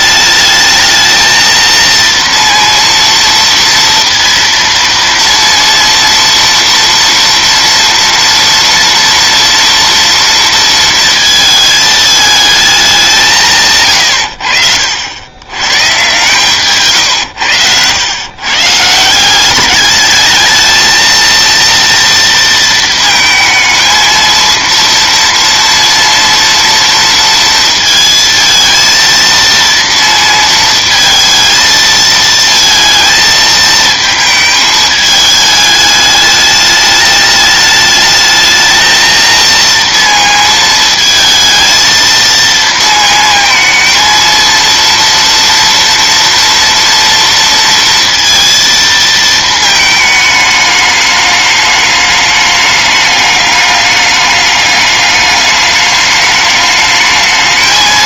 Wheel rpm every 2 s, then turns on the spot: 220, 230, 230, 230, 230, 230, 200, 70, 140, 140, 220, 220, 230, 230, 230, 230, 220, 220, 210, 220, 230, 230, 230, 240, 230, 210, 210, 210, 210.
none